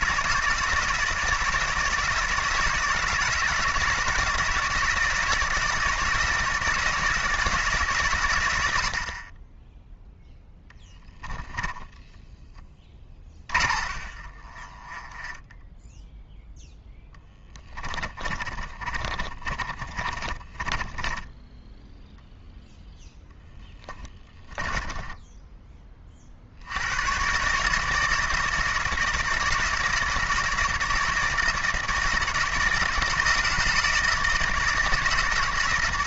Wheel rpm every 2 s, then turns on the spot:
160, 160, 160, 160, 90, 10, 10, 30, 0, 30, 20, 0, 20, 70, 160, 160, 160, 160.
10-16 18-22 24-26